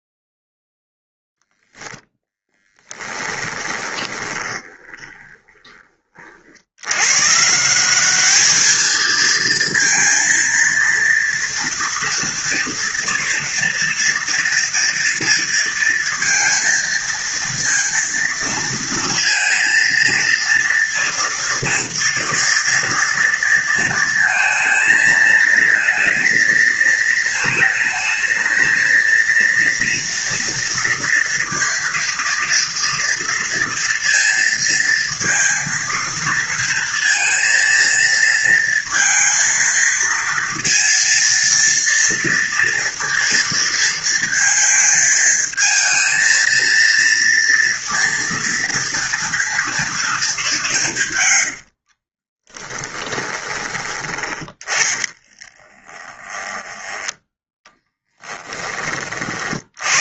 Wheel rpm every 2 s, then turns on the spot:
0, 10, 20, 90, 220, 230, 230, 230, 230, 230, 240, 230, 220, 220, 230, 230, 230, 230, 230, 230, 230, 230, 220, 230, 230, 160, 10, 20, 10, 30.
2-6 52-58